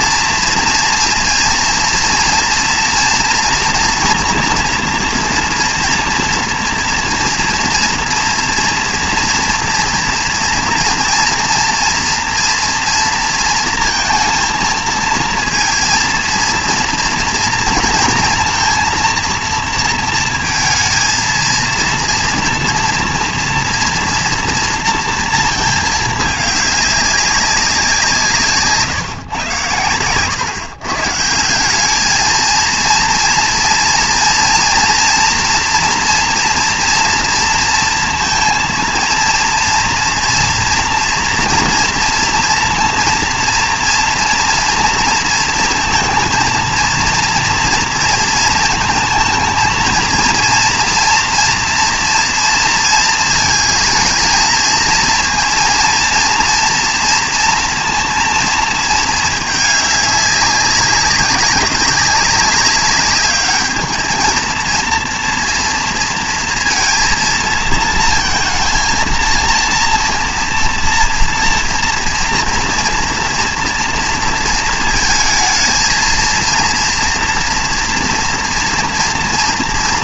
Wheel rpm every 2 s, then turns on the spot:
230, 230, 230, 230, 230, 230, 230, 230, 230, 230, 230, 230, 230, 210, 150, 120, 220, 230, 240, 230, 230, 230, 230, 230, 230, 230, 230, 220, 230, 230, 200, 200, 220, 230, 230, 230, 240, 220, 230, 230.
none